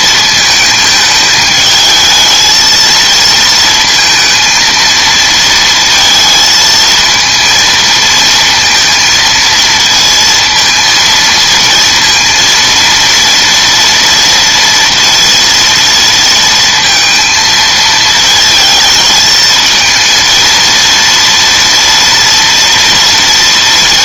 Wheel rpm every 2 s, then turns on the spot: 220, 230, 230, 220, 230, 220, 230, 230, 230, 220, 230, 230.
none